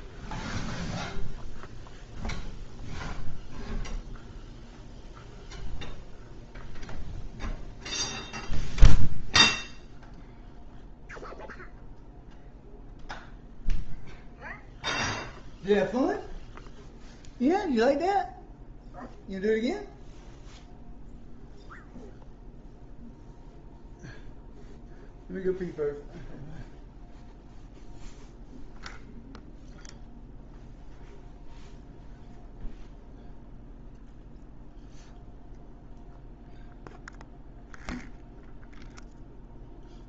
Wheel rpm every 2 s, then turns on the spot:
0, 0, 0, 0, 0, 0, 0, 0, 0, 0, 0, 0, 0, 0, 0, 0, 0, 0, 0, 0.
none